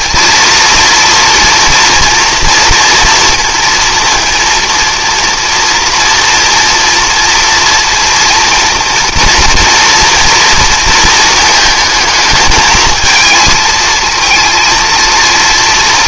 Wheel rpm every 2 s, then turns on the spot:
230, 240, 230, 230, 230, 230, 220, 230.
none